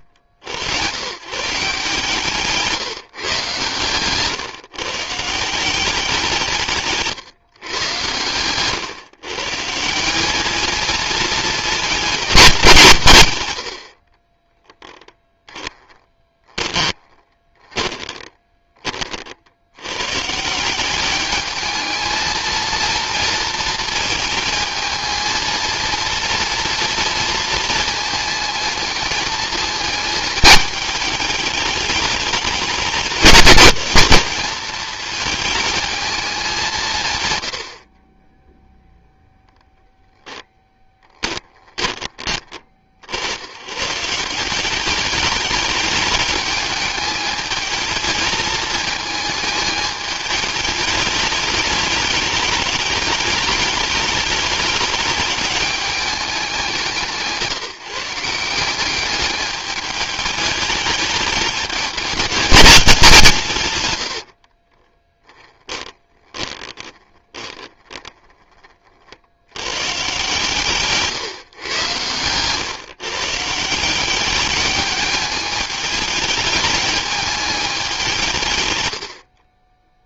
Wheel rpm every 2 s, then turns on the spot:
90, 160, 140, 150, 130, 230, 160, 10, 20, 30, 200, 230, 220, 230, 220, 210, 200, 210, 150, 0, 20, 60, 200, 210, 220, 210, 210, 210, 160, 200, 210, 200, 10, 20, 40, 140, 150, 210, 210, 100.
14-18 40-42 64-68